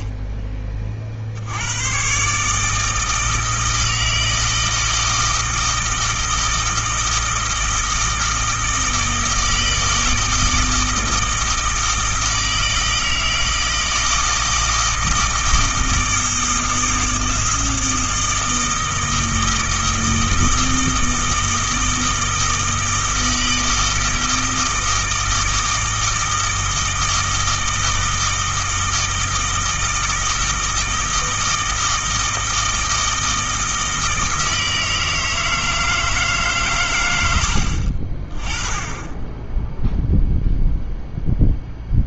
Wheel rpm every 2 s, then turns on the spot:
30, 150, 160, 160, 160, 160, 160, 160, 160, 160, 160, 160, 160, 160, 160, 160, 160, 160, 130, 20, 0.
none